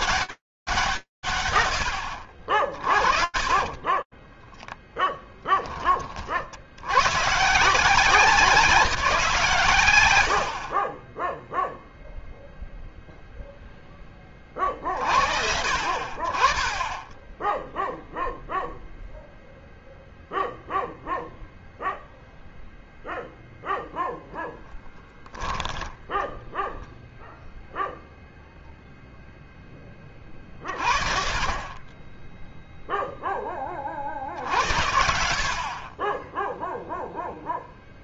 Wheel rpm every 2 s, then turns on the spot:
60, 10, 70, 170, 50, 0, 20, 40, 0, 0, 0, 0, 10, 0, 10, 30, 20, 70, 0.
2-4 8-10 24-26